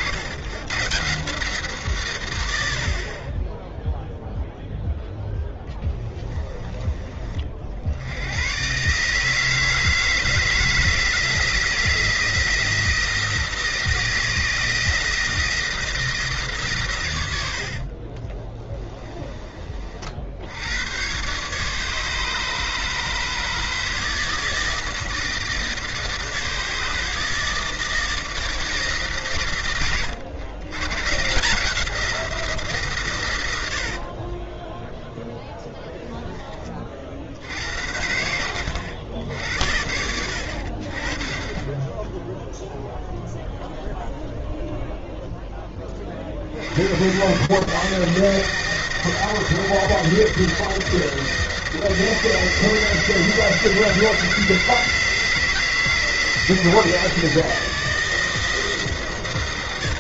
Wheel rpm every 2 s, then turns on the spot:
120, 80, 0, 20, 120, 160, 170, 160, 150, 20, 80, 160, 160, 160, 160, 110, 160, 10, 30, 90, 60, 0, 0, 60, 160, 170, 160, 160, 170, 160.
18-20 34-36